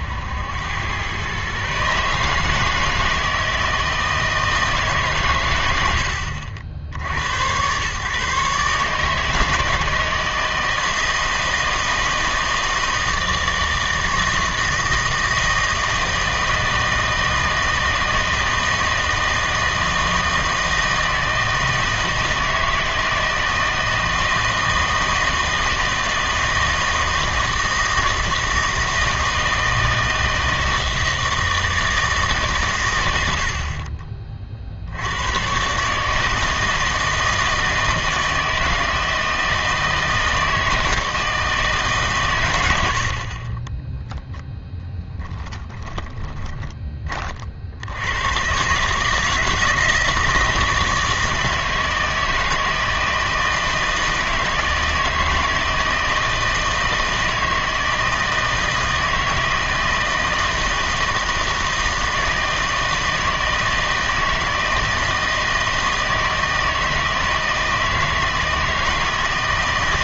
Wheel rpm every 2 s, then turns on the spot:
100, 160, 160, 70, 150, 160, 160, 160, 160, 160, 160, 160, 160, 160, 160, 160, 120, 50, 160, 160, 160, 90, 0, 10, 130, 160, 160, 160, 160, 160, 160, 160, 160, 160, 160.
none